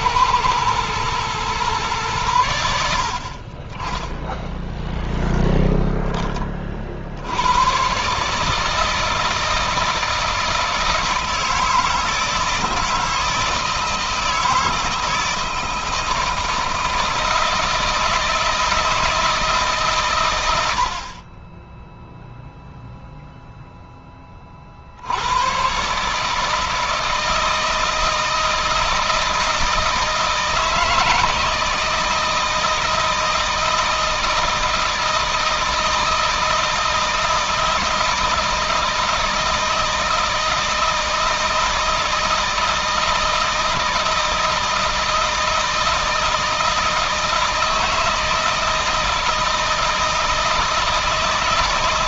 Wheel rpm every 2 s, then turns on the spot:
110, 70, 0, 50, 160, 160, 160, 160, 160, 160, 70, 0, 60, 160, 160, 160, 160, 160, 160, 160, 160, 160, 160, 160, 160, 160.
none